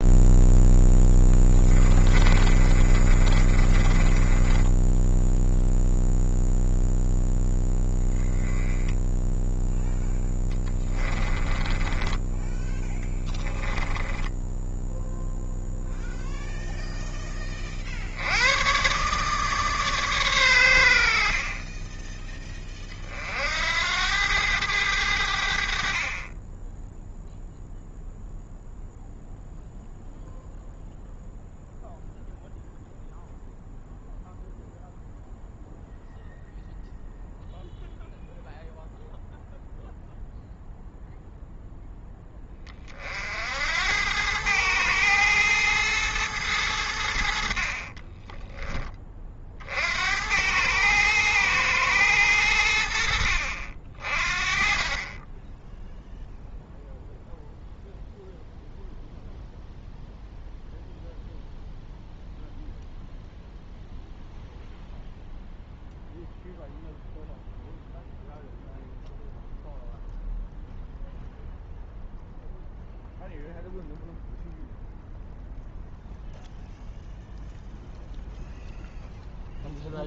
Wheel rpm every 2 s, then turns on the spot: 0, 30, 10, 0, 10, 20, 10, 10, 0, 120, 90, 30, 100, 10, 0, 0, 0, 0, 0, 0, 0, 30, 110, 100, 20, 110, 80, 30, 0, 0, 0, 0, 0, 0, 0, 0, 0, 0, 0, 0.
2-6 10-12